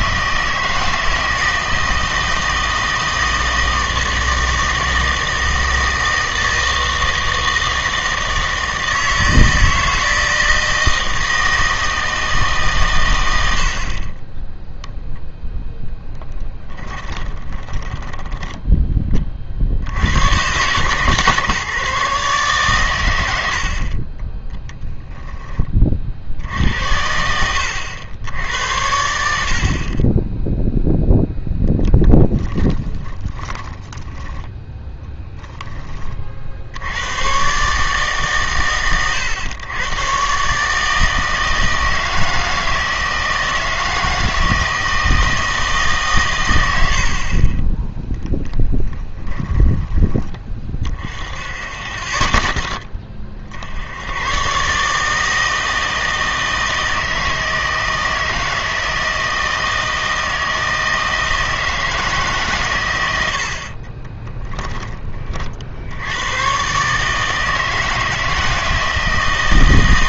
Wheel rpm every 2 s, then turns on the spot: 160, 160, 160, 160, 160, 160, 140, 10, 20, 10, 130, 130, 10, 80, 90, 0, 20, 10, 70, 130, 150, 160, 160, 90, 20, 30, 20, 130, 160, 160, 160, 130, 20, 130, 160.
16-18 24-26 32-36 48-50 64-66